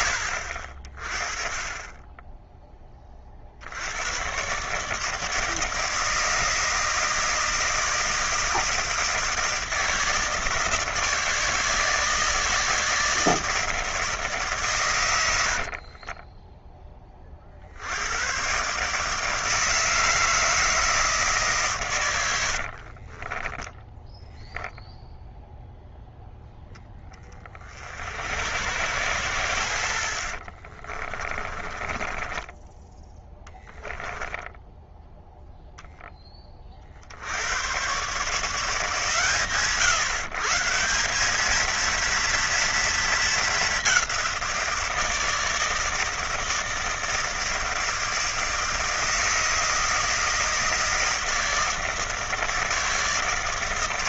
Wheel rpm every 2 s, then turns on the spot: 60, 20, 140, 160, 160, 160, 160, 130, 10, 140, 160, 50, 0, 10, 90, 40, 10, 0, 40, 140, 170, 230, 170, 160, 160, 160, 160.
22-24 30-34